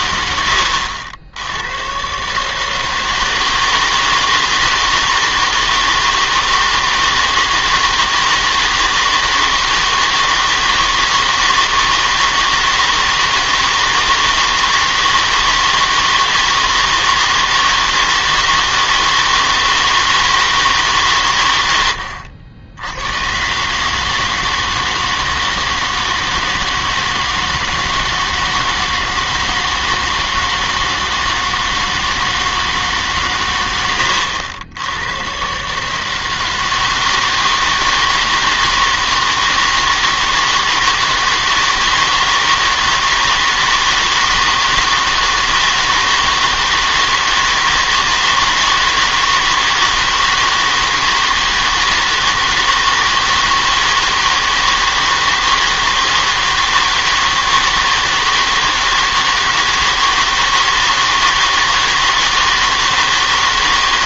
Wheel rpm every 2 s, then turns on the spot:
80, 150, 160, 160, 160, 160, 160, 160, 160, 160, 160, 90, 160, 160, 160, 160, 160, 90, 160, 160, 160, 160, 160, 160, 160, 160, 160, 160, 160, 160, 160, 160.
0-2